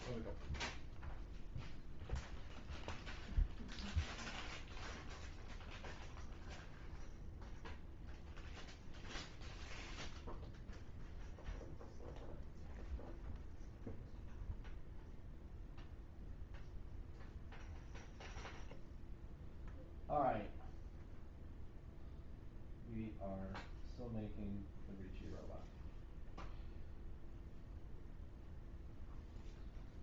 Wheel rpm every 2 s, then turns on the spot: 0, 0, 0, 0, 0, 0, 0, 0, 0, 0, 0, 0, 0, 0, 0.
none